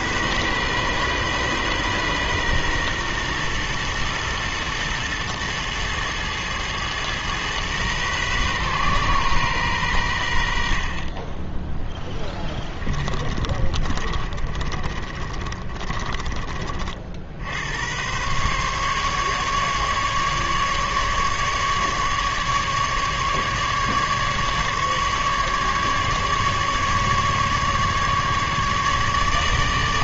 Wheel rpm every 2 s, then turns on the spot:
130, 120, 110, 110, 130, 70, 20, 40, 40, 140, 150, 150, 150, 140, 150.
12-16